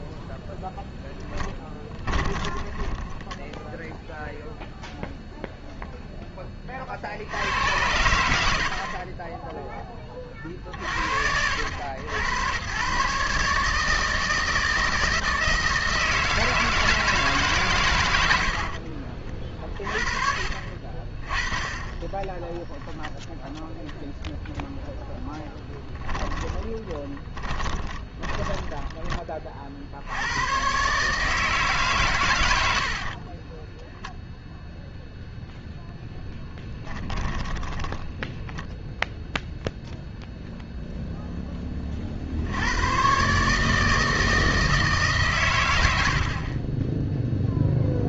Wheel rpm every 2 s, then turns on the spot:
10, 10, 0, 30, 50, 60, 110, 160, 160, 50, 40, 10, 0, 30, 20, 130, 70, 0, 10, 10, 0, 100, 160, 10.
2-4 18-20 26-30 36-38 46-48